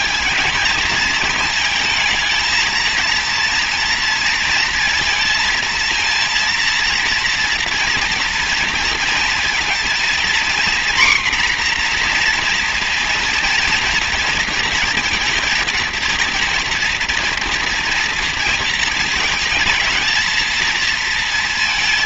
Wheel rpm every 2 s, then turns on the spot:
220, 230, 230, 230, 230, 250, 240, 230, 230, 230, 230.
none